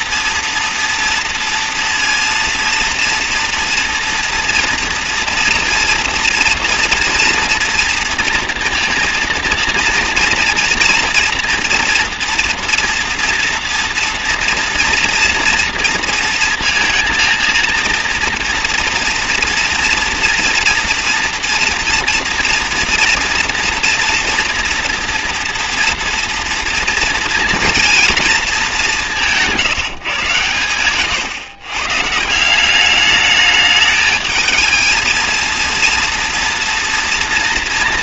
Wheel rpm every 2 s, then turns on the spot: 230, 230, 230, 230, 230, 230, 230, 230, 230, 230, 230, 230, 230, 230, 200, 120, 200, 220, 230.
30-32